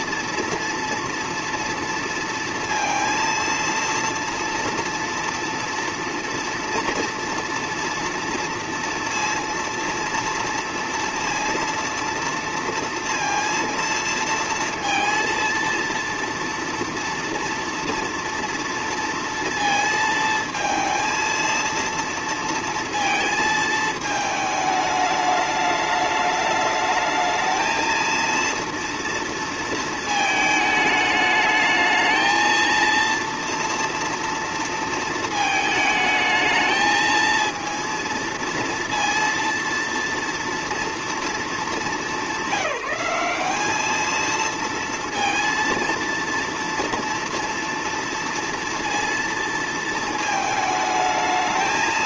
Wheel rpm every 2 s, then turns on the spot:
230, 230, 230, 230, 230, 230, 230, 230, 230, 230, 230, 230, 220, 210, 230, 220, 220, 230, 220, 230, 230, 190, 230, 230, 230, 220.
none